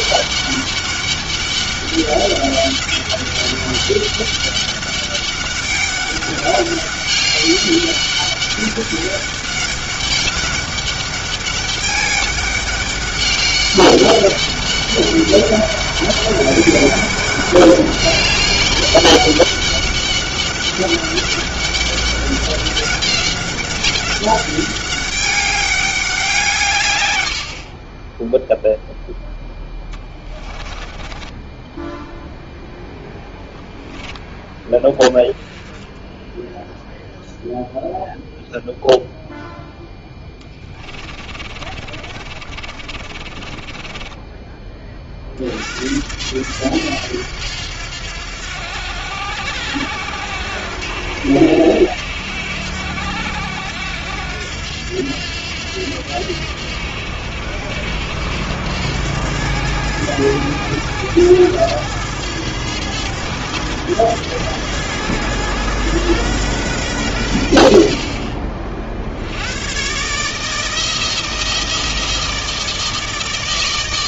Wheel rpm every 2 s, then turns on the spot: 200, 200, 200, 200, 200, 200, 200, 200, 200, 200, 200, 200, 200, 160, 0, 20, 0, 10, 0, 0, 20, 40, 20, 100, 90, 90, 90, 90, 80, 90, 110, 110, 110, 120, 50, 160, 160.
30-32 40-44